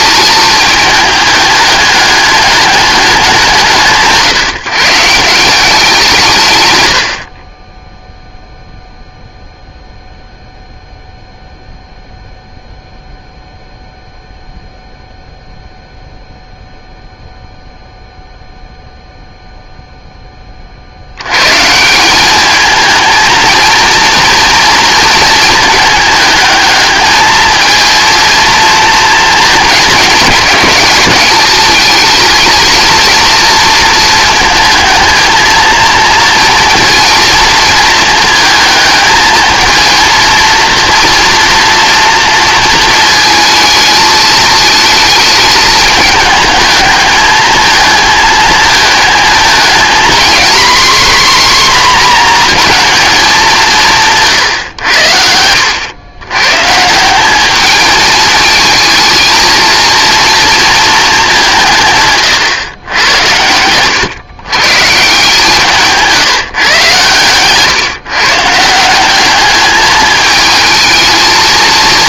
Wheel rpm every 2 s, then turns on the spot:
210, 210, 150, 120, 0, 0, 0, 0, 0, 0, 30, 220, 230, 210, 230, 210, 220, 230, 230, 220, 230, 230, 220, 210, 220, 250, 230, 110, 140, 220, 220, 100, 130, 140, 170, 220.
none